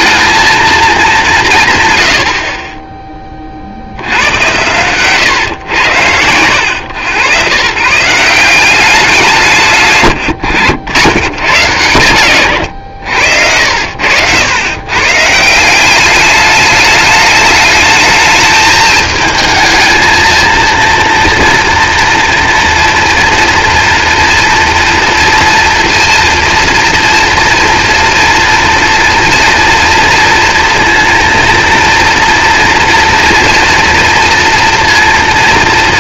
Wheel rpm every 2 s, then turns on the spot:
220, 30, 110, 110, 190, 90, 100, 110, 210, 220, 230, 240, 230, 230, 230, 230, 240, 230.
none